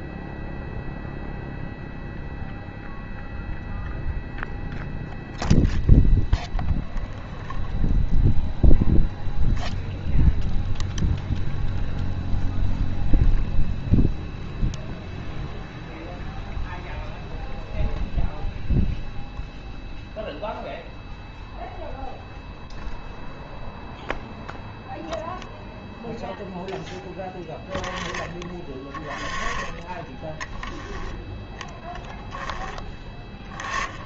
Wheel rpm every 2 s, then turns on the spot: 0, 0, 0, 0, 0, 0, 0, 0, 0, 0, 0, 0, 0, 0, 20, 10, 10.
none